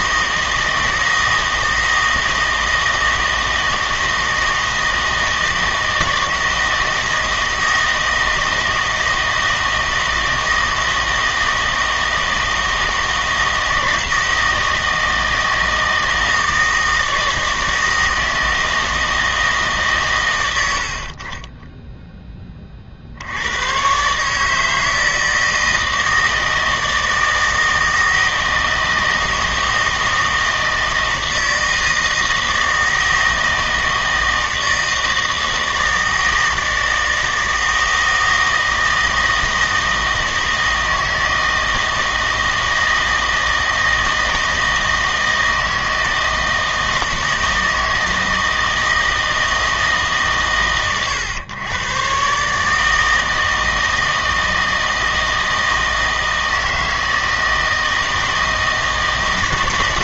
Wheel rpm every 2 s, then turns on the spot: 160, 160, 160, 160, 160, 160, 160, 160, 160, 160, 90, 20, 150, 160, 160, 160, 160, 160, 160, 160, 160, 160, 160, 160, 160, 130, 150, 160, 160, 160.
none